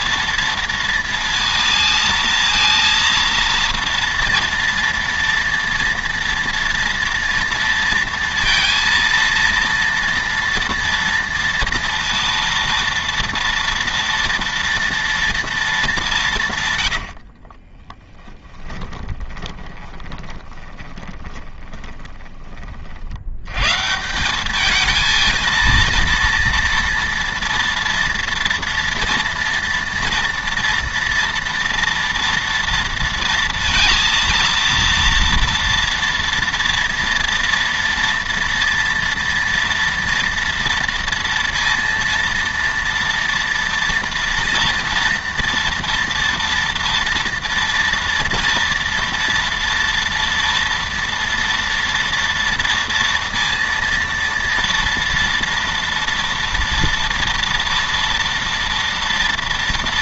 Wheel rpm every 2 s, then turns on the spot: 230, 230, 230, 230, 230, 230, 230, 230, 150, 10, 20, 40, 200, 230, 230, 240, 230, 230, 230, 230, 230, 230, 230, 230, 230, 230, 230, 230, 230, 230.
18-22